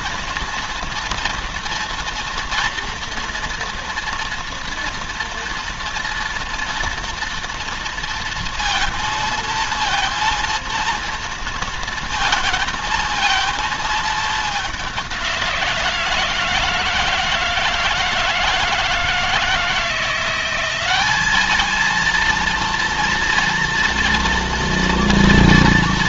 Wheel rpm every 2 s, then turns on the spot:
230, 230, 230, 230, 230, 230, 220, 200, 160, 160, 190, 230, 230.
none